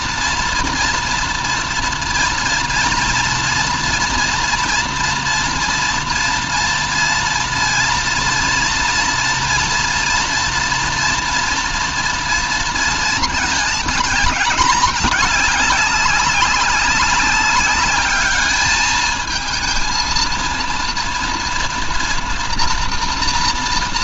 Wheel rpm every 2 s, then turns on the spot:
230, 240, 230, 230, 230, 230, 230, 210, 200, 220, 230, 240.
none